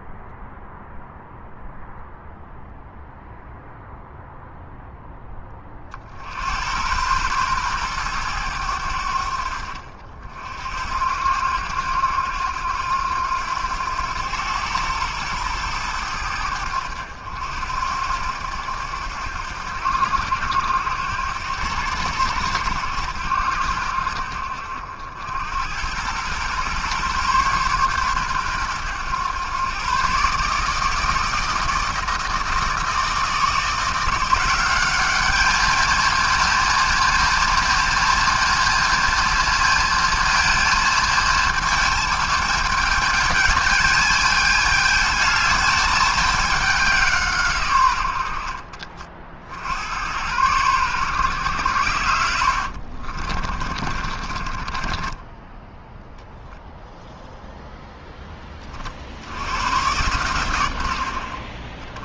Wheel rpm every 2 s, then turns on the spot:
0, 0, 10, 110, 90, 70, 90, 110, 90, 80, 80, 80, 70, 130, 110, 160, 160, 190, 230, 230, 230, 220, 220, 190, 40, 110, 60, 20, 0, 60, 70.
52-56